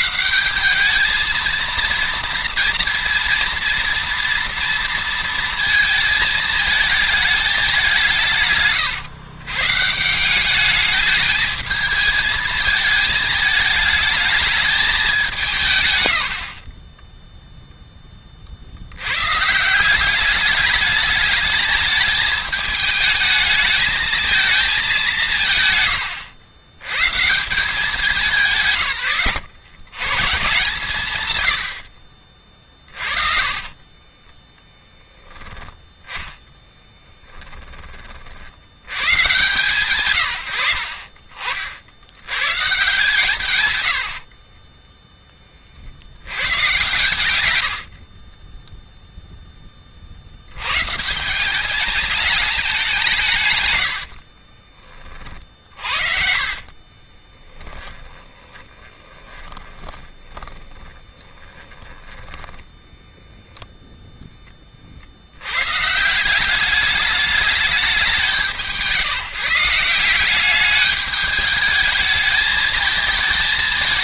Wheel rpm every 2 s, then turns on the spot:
200, 230, 230, 220, 140, 210, 220, 210, 40, 80, 210, 220, 200, 110, 150, 140, 40, 10, 10, 100, 70, 130, 30, 120, 10, 140, 200, 50, 40, 20, 40, 20, 40, 200, 170, 200, 220.
32-34 36-38 54-64